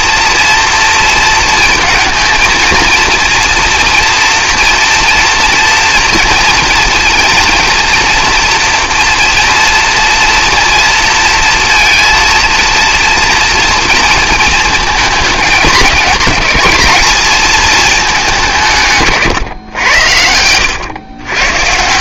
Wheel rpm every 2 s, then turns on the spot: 230, 220, 230, 230, 240, 230, 230, 220, 220, 170, 100.
none